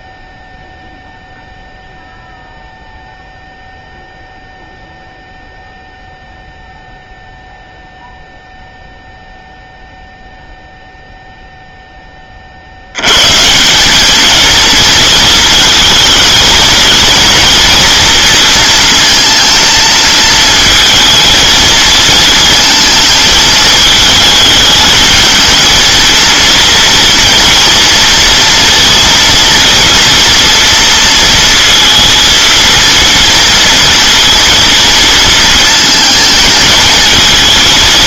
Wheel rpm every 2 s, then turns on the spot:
0, 0, 0, 0, 0, 0, 80, 230, 220, 230, 220, 220, 210, 240, 230, 230, 230, 230, 220.
none